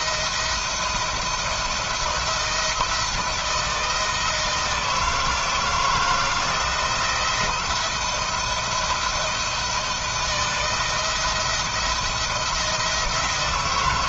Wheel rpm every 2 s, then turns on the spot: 170, 160, 160, 170, 170, 160, 170.
none